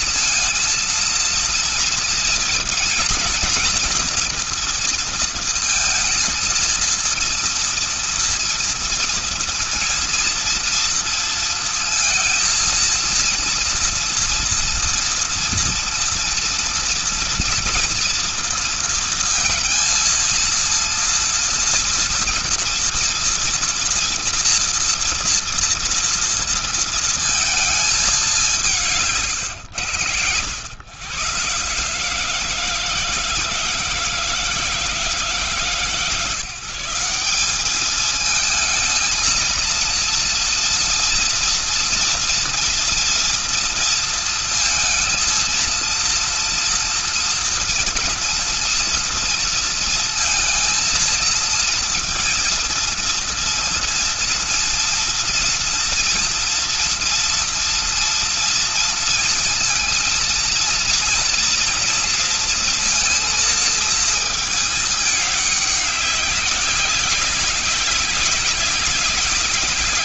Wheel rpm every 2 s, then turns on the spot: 230, 230, 230, 230, 230, 230, 230, 240, 230, 230, 230, 230, 230, 230, 150, 120, 160, 160, 170, 220, 240, 230, 230, 230, 230, 230, 230, 230, 230, 230, 230, 230, 210, 200, 200.
none